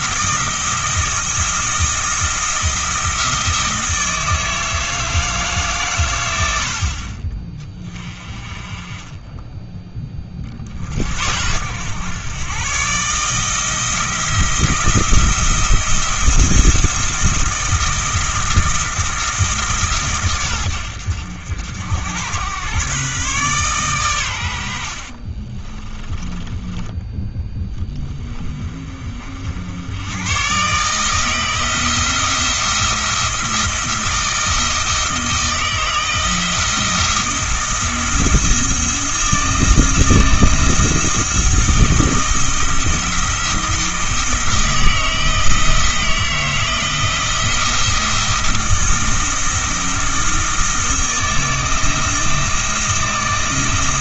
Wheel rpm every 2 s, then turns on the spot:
170, 170, 160, 60, 30, 50, 140, 170, 170, 160, 100, 120, 70, 10, 30, 140, 170, 160, 170, 170, 160, 160, 160, 170, 170, 160, 170.
24-28